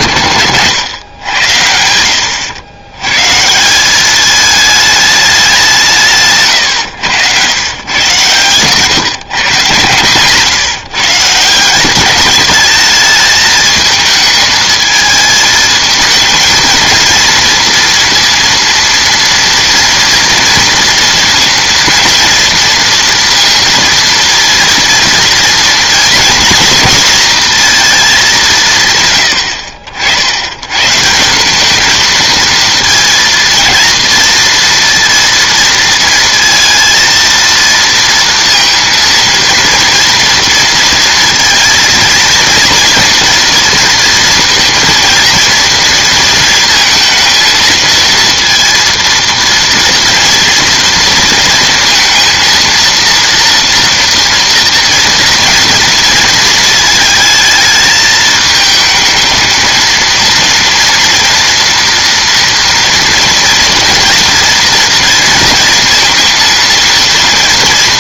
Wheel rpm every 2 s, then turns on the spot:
120, 100, 210, 130, 130, 140, 210, 220, 220, 230, 230, 230, 230, 230, 160, 100, 230, 230, 230, 230, 230, 230, 230, 230, 230, 230, 230, 230, 220, 220, 230, 230, 230, 230.
none